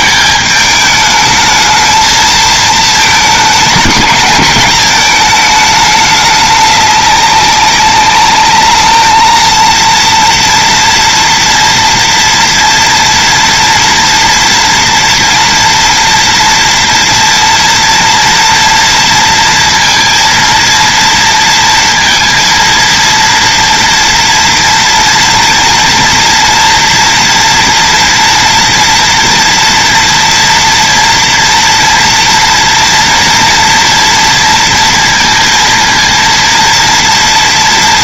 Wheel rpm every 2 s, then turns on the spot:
220, 220, 210, 210, 200, 230, 230, 230, 230, 230, 230, 230, 230, 230, 230, 230, 230, 230, 230.
none